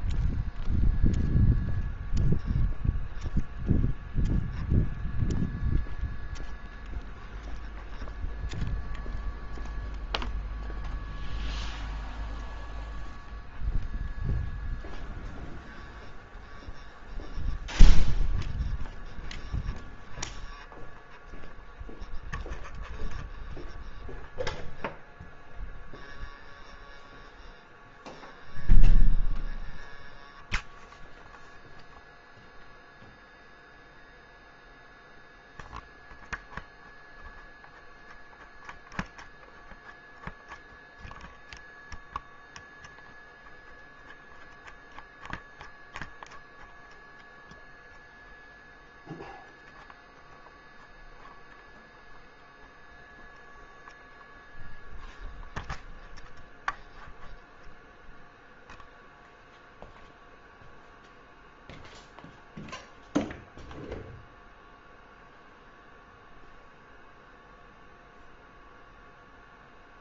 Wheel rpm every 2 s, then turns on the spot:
0, 0, 0, 0, 0, 0, 0, 0, 0, 0, 0, 0, 0, 0, 0, 0, 0, 0, 0, 0, 0, 0, 0, 0, 0, 0, 0, 0, 0, 0, 0, 0, 0, 0, 0.
none